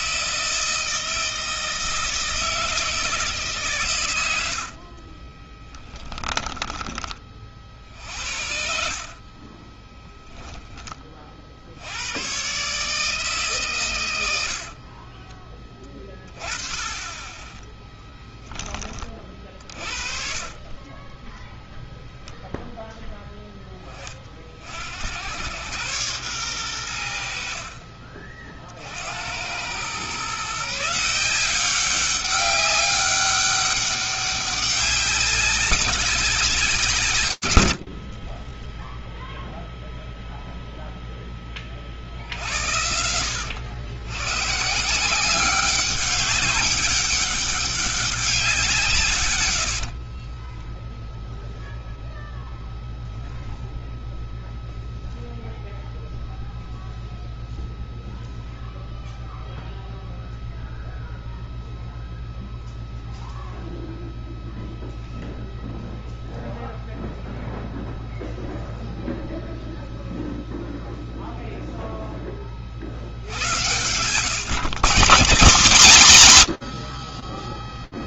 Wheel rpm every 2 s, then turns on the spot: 160, 160, 100, 10, 60, 10, 110, 100, 30, 10, 40, 0, 50, 110, 40, 140, 190, 200, 180, 40, 0, 70, 130, 200, 180, 20, 0, 0, 0, 0, 0, 0, 0, 0, 0, 0, 50, 160, 50.
6-8 20-22 50-52